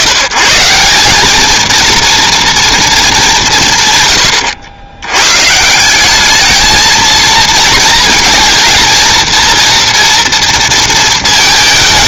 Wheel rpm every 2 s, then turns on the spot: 160, 230, 100, 220, 230, 230.
none